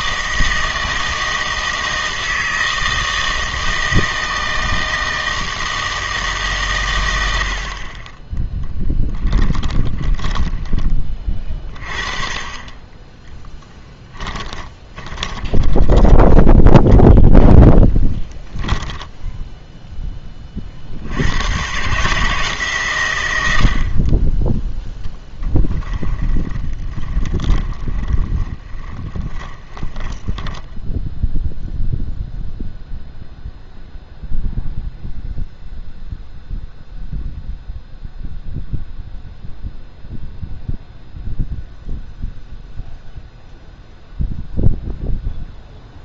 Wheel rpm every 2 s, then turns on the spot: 160, 160, 160, 140, 10, 20, 20, 20, 10, 10, 40, 140, 10, 20, 30, 10, 0, 0, 0, 0, 0, 0, 0.
8-10 14-20 26-30